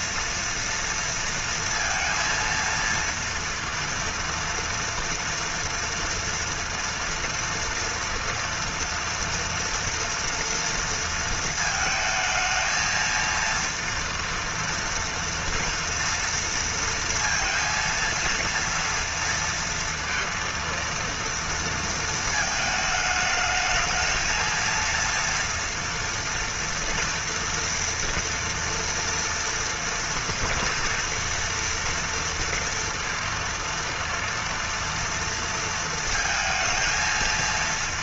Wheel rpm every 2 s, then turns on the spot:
230, 230, 230, 230, 230, 230, 220, 230, 230, 230, 230, 220, 230, 230, 230, 230, 230, 230, 230.
none